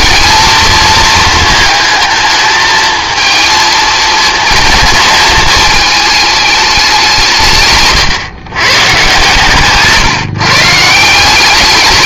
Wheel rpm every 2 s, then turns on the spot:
220, 220, 230, 210, 130, 140.
none